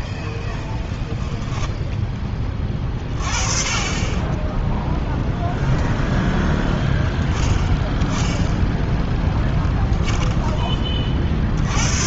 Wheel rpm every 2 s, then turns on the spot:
0, 20, 10, 10, 10, 20.
4-6